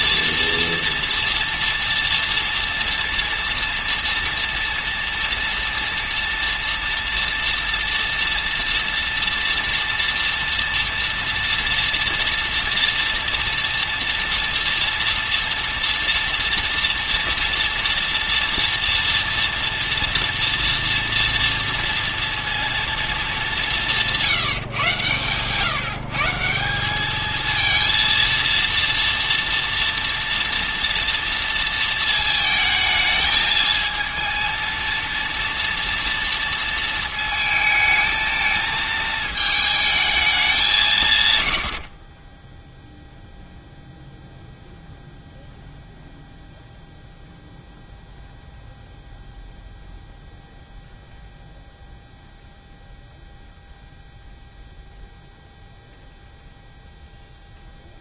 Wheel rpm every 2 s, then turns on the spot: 230, 230, 230, 230, 230, 230, 240, 230, 230, 230, 240, 230, 130, 180, 230, 240, 220, 230, 230, 220, 160, 0, 0, 0, 0, 0, 0, 0, 0.
none